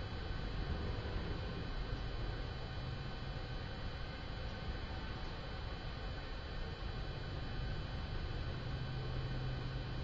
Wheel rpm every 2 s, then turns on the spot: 0, 0, 0, 0, 0.
none